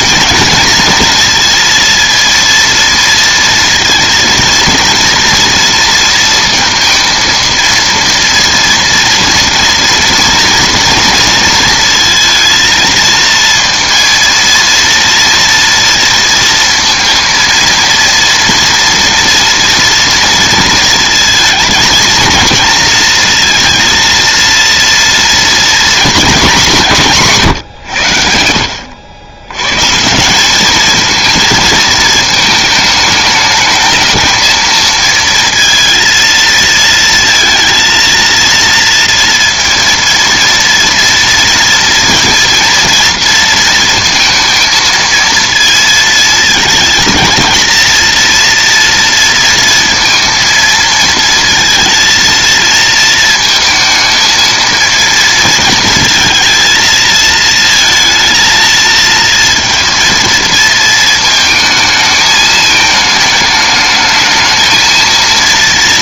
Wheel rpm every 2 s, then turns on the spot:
230, 230, 230, 230, 230, 230, 230, 230, 230, 230, 230, 230, 230, 200, 80, 200, 220, 220, 230, 230, 230, 230, 220, 220, 230, 230, 230, 220, 230, 230, 230, 220, 220.
none